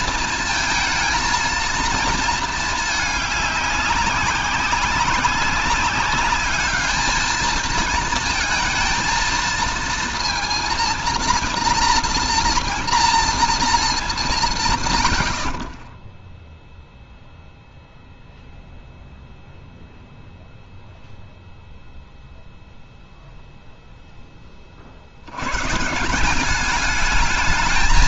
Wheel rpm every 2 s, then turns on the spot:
230, 220, 190, 210, 230, 230, 230, 150, 0, 0, 0, 0, 40, 190.
none